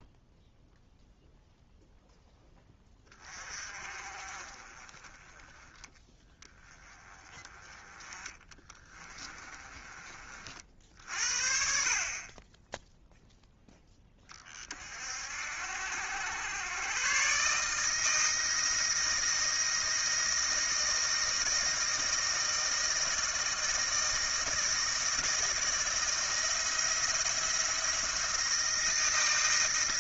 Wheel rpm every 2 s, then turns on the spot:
0, 10, 20, 10, 30, 60, 10, 40, 110, 160, 160, 160, 160, 170, 170.
8-10